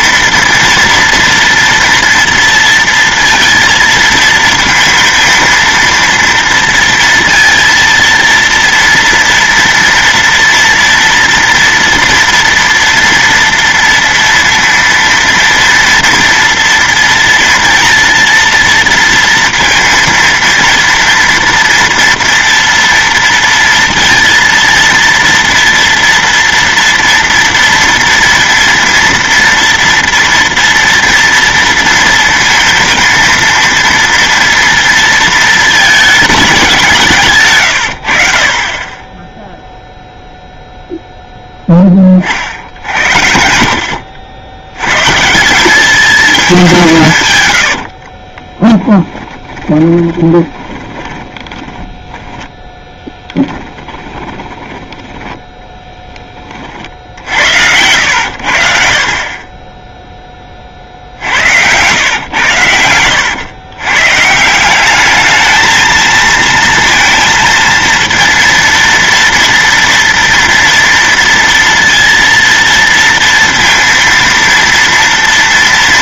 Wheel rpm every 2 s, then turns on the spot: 230, 230, 230, 230, 230, 230, 230, 230, 230, 230, 230, 230, 230, 230, 230, 230, 230, 230, 180, 30, 0, 60, 90, 190, 20, 20, 20, 20, 30, 60, 40, 100, 180, 230, 230, 230, 230, 230.
48-56